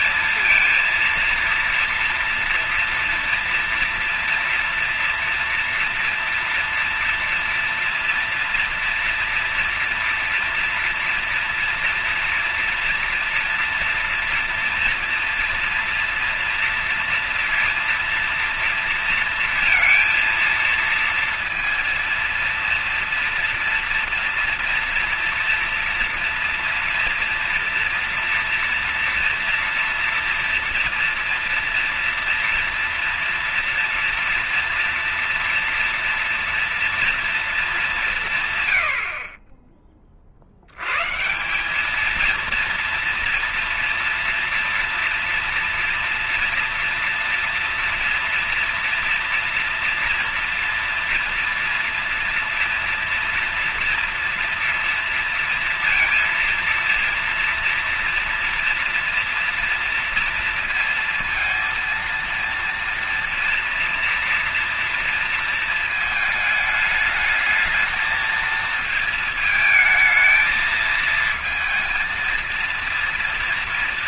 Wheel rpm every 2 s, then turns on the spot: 230, 230, 230, 230, 230, 230, 230, 230, 230, 230, 230, 230, 230, 230, 230, 230, 230, 230, 230, 150, 50, 220, 230, 230, 230, 230, 230, 230, 230, 240, 230, 230, 230, 220, 220, 220, 230.
none